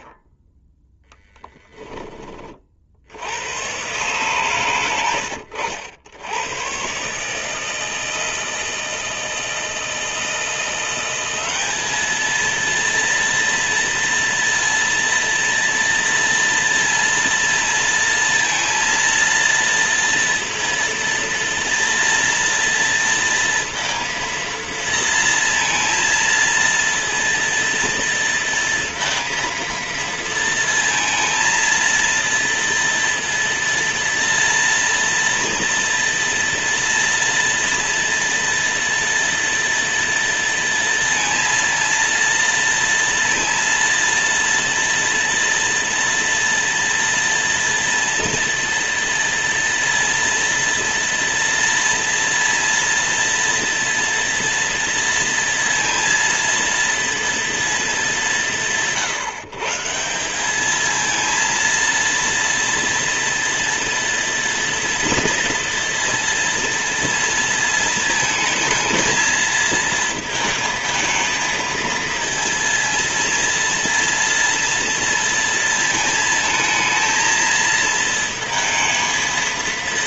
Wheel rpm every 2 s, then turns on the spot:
10, 30, 120, 120, 160, 170, 230, 230, 230, 230, 230, 230, 230, 230, 230, 230, 230, 230, 230, 230, 230, 230, 230, 230, 230, 230, 230, 230, 230, 150, 210, 230, 230, 230, 220, 220, 230, 230, 220, 220.
none